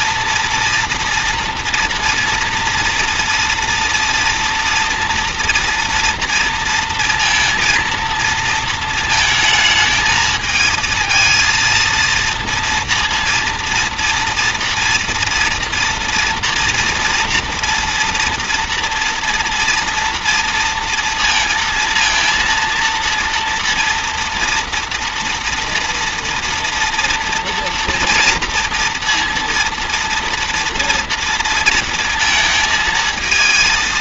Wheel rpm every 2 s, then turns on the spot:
230, 230, 240, 230, 230, 220, 230, 230, 230, 230, 230, 230, 230, 230, 230, 230, 230.
none